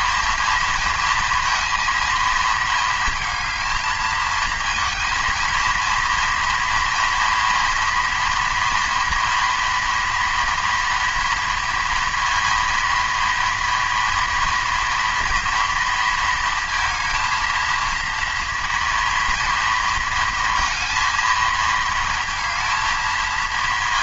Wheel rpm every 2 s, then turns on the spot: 230, 220, 230, 230, 230, 230, 230, 240, 230, 230, 230, 220.
none